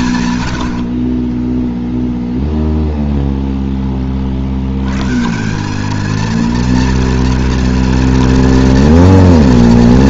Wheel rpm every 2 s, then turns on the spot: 100, 0, 70, 230, 230.
none